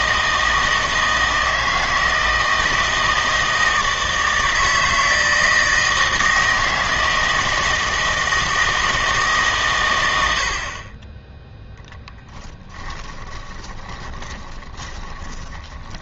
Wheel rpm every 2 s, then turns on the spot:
160, 160, 160, 160, 160, 50, 10, 20.
12-16